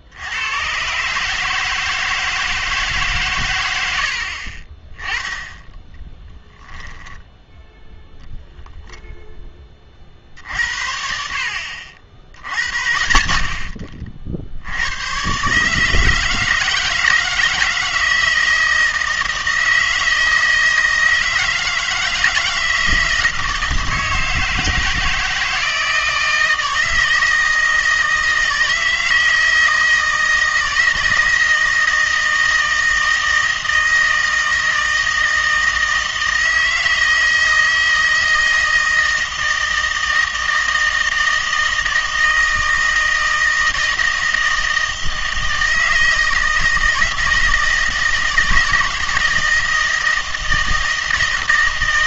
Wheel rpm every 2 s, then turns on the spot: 100, 160, 50, 10, 0, 50, 80, 70, 160, 160, 160, 160, 160, 160, 160, 160, 160, 160, 160, 160, 160, 160, 160, 160, 160, 160.
none